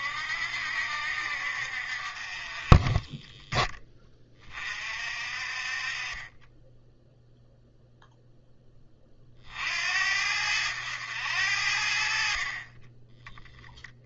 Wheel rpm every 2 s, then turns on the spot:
60, 30, 40, 10, 20, 90, 30.
none